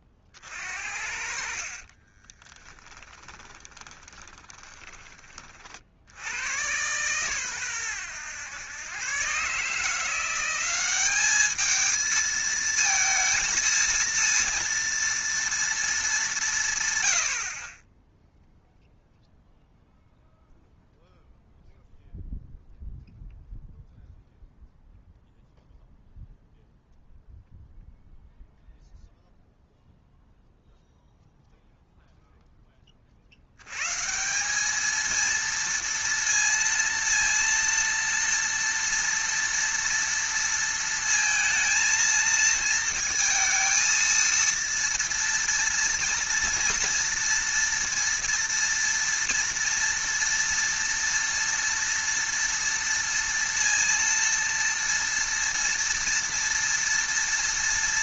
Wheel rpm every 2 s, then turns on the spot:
50, 20, 30, 100, 100, 190, 230, 230, 170, 0, 0, 0, 0, 0, 0, 0, 10, 200, 230, 230, 230, 220, 230, 230, 230, 230, 230, 230, 230.
2-6